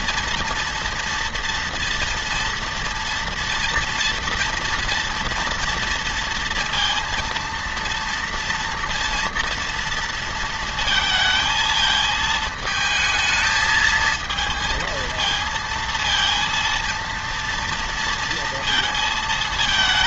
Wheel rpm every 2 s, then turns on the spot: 230, 230, 230, 230, 230, 230, 220, 220, 230, 230.
none